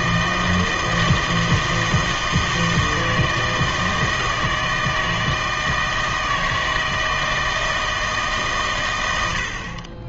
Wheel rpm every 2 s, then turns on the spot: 160, 160, 160, 160, 110.
none